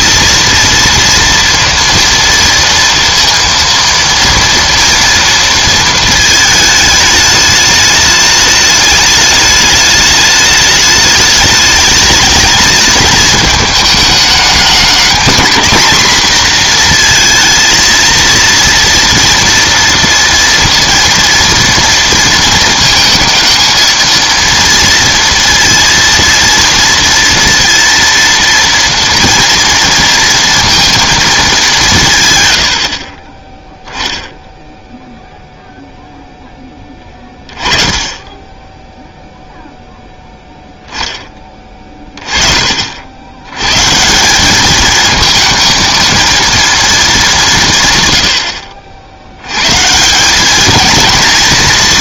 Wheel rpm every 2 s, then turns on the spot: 230, 230, 230, 210, 210, 210, 220, 210, 230, 230, 230, 230, 230, 230, 230, 230, 80, 0, 20, 0, 10, 70, 220, 210, 80, 230.
none